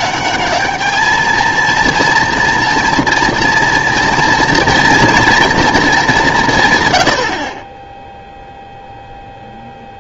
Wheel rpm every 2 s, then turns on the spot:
220, 240, 230, 140, 0.
none